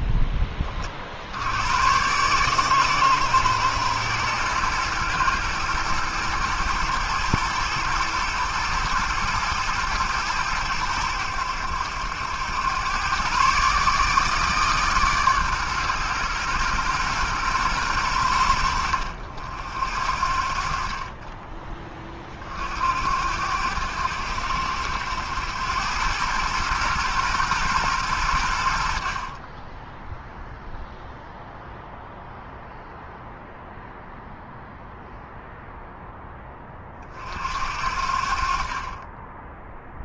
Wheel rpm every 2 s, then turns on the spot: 50, 130, 120, 110, 110, 100, 110, 140, 120, 70, 30, 70, 90, 120, 60, 0, 0, 0, 30, 40.
none